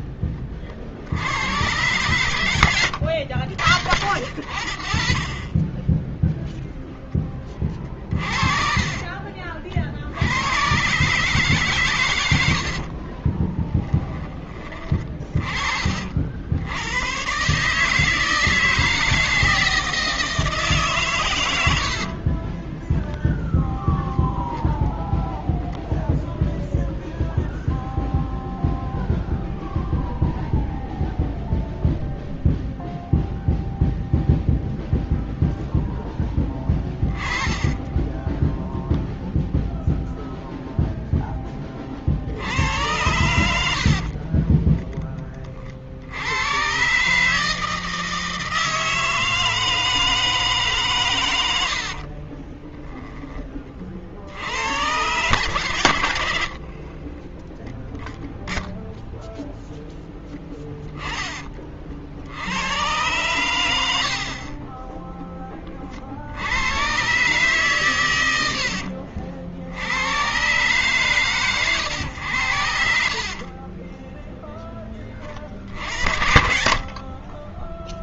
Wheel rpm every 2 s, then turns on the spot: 30, 110, 80, 10, 40, 100, 100, 20, 70, 160, 150, 20, 0, 0, 0, 0, 0, 0, 0, 10, 0, 60, 30, 100, 160, 150, 30, 70, 60, 0, 10, 80, 30, 60, 90, 120, 110, 10, 40.
8-10 12-14 22-24 44-46 52-54 60-62 74-78